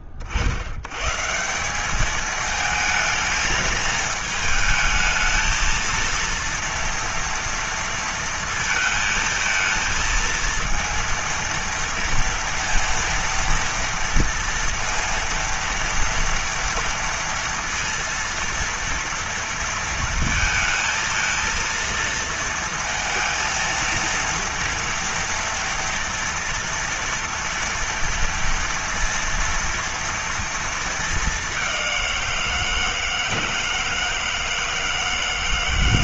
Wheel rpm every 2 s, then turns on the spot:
30, 220, 220, 230, 230, 220, 230, 230, 230, 230, 230, 230, 230, 230, 230, 230, 180, 160.
none